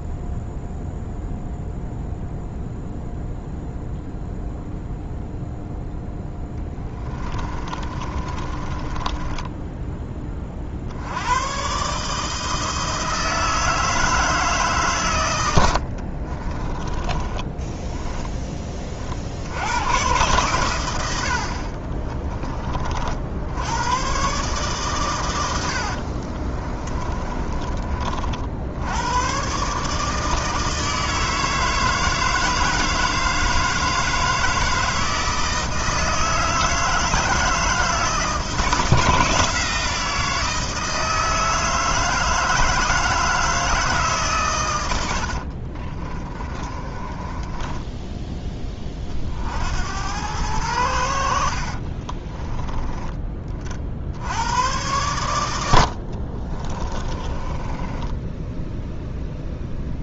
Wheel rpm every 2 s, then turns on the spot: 0, 0, 0, 20, 20, 60, 160, 140, 20, 30, 100, 40, 130, 30, 90, 160, 160, 160, 160, 160, 160, 160, 110, 30, 30, 90, 20, 100, 30, 0.
6-10 16-18 26-28 46-48 56-58